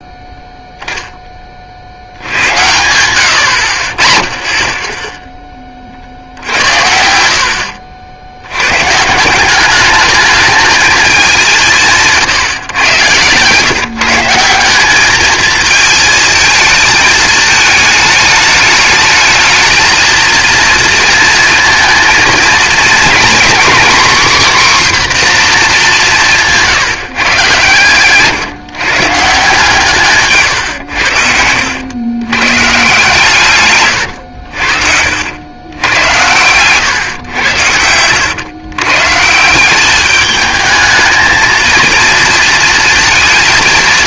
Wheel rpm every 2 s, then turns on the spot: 0, 80, 20, 70, 100, 220, 130, 190, 220, 210, 230, 230, 260, 170, 150, 130, 140, 70, 120, 130, 220, 230.
2-4 36-38